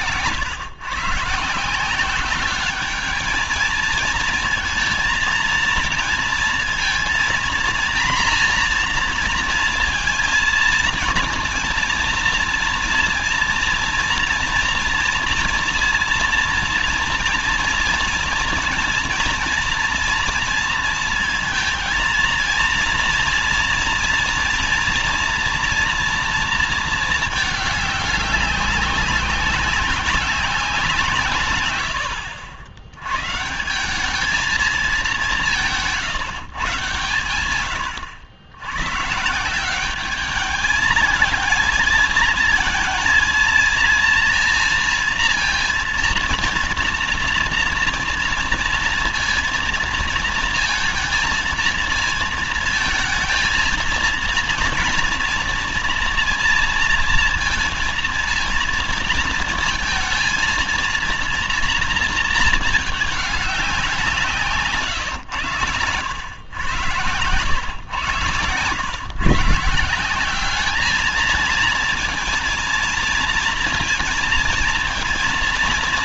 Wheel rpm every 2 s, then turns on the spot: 110, 200, 220, 230, 240, 230, 230, 240, 230, 230, 230, 220, 230, 230, 200, 190, 90, 210, 150, 110, 210, 220, 230, 230, 230, 220, 230, 230, 230, 230, 230, 220, 150, 100, 120, 200, 230, 230.
none